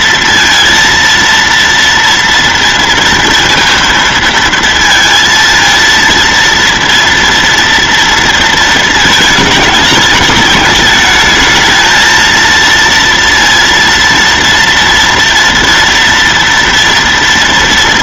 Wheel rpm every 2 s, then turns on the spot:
230, 230, 230, 230, 220, 210, 230, 230, 230.
none